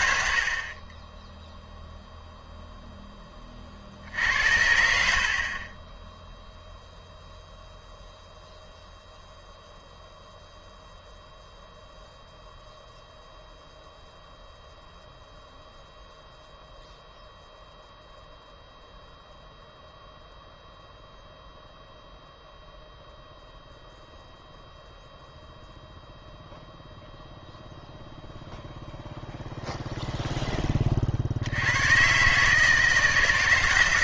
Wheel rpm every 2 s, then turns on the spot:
30, 0, 70, 0, 0, 0, 0, 0, 0, 0, 0, 0, 0, 0, 0, 30, 160.
none